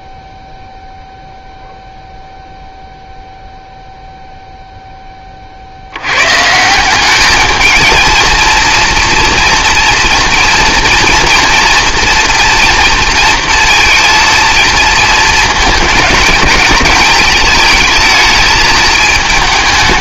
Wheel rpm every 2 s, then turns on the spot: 0, 0, 0, 150, 230, 230, 240, 230, 220, 220.
none